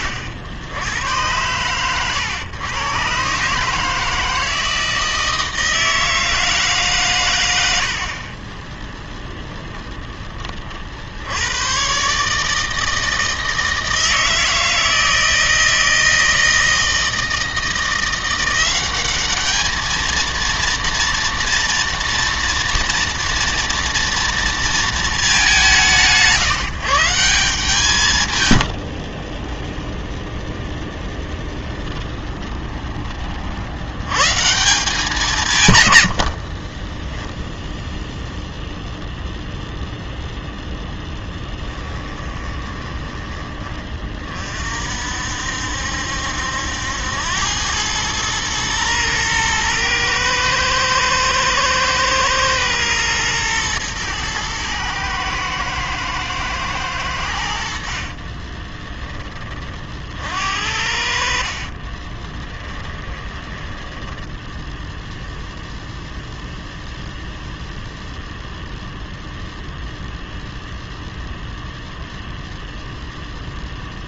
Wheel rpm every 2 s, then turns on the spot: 90, 120, 160, 140, 0, 50, 160, 160, 160, 190, 230, 230, 230, 160, 70, 10, 20, 170, 20, 0, 0, 20, 50, 80, 110, 120, 120, 110, 110, 20, 60, 10, 0, 0, 0, 0, 0.
28-32 36-38 42-44 58-60 62-64